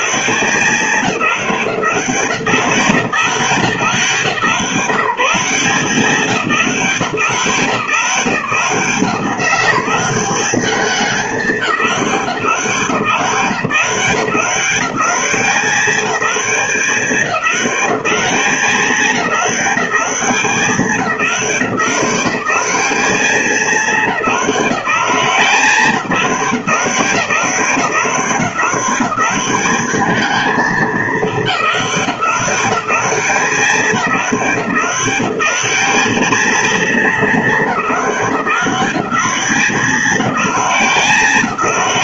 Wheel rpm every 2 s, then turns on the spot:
200, 180, 170, 150, 180, 200, 170, 190, 200, 200, 200, 200, 200, 190, 190, 220, 200, 200, 220, 200, 200.
none